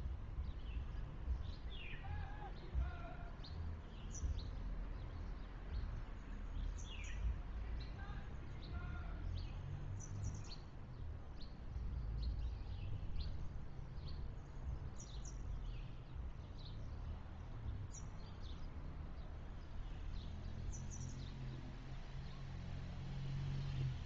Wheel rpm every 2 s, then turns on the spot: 0, 0, 0, 0, 0, 0, 0, 0, 0, 0, 0, 0.
none